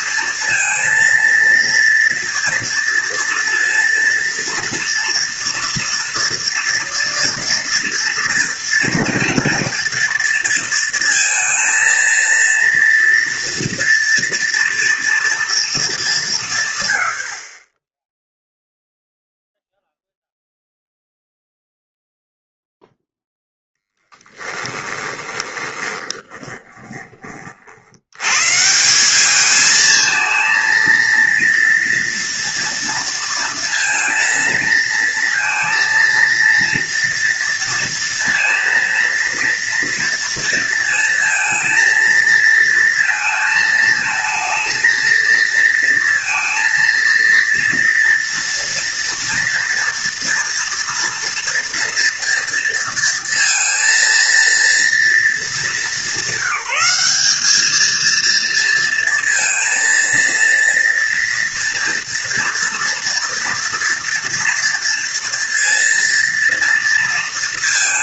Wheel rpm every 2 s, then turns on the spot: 230, 240, 230, 230, 230, 230, 240, 230, 140, 0, 0, 0, 10, 20, 150, 230, 230, 230, 230, 230, 230, 230, 220, 230, 240, 230, 230, 230, 200, 230, 230, 230, 230, 230.
24-28